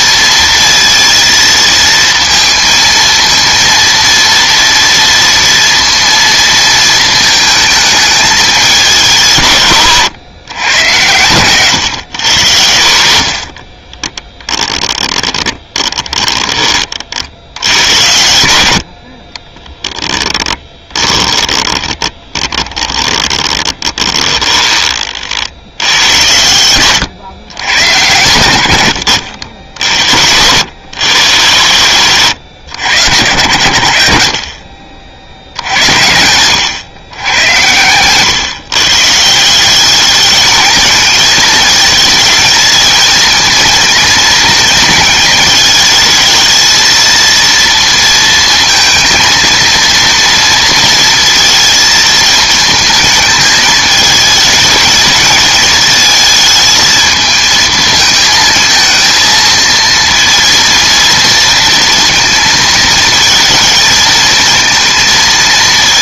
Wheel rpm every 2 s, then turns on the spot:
230, 230, 230, 220, 190, 100, 100, 10, 20, 90, 20, 20, 30, 110, 100, 100, 100, 40, 100, 140, 210, 220, 230, 220, 230, 230, 220, 220, 220, 220, 230, 220, 230.
14-16 18-24 26-28